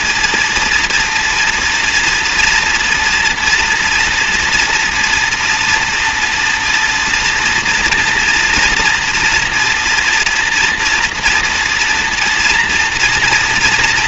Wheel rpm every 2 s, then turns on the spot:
230, 240, 230, 230, 240, 230, 230.
none